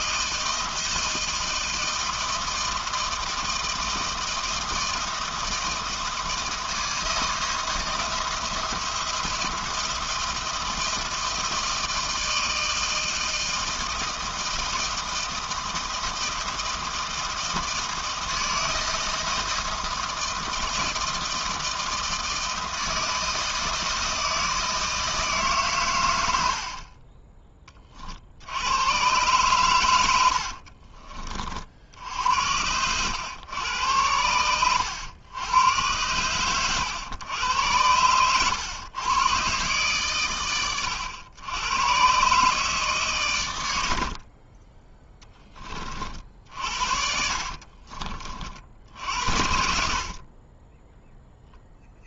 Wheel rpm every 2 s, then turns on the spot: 160, 160, 160, 160, 170, 160, 160, 160, 160, 160, 160, 160, 160, 30, 110, 50, 90, 110, 110, 120, 110, 140, 10, 50, 60, 10.
26-28 30-32 44-48